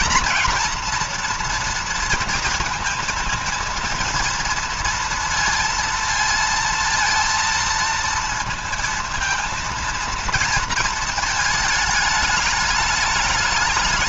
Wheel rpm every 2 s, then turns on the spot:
230, 230, 230, 230, 230, 230, 210.
none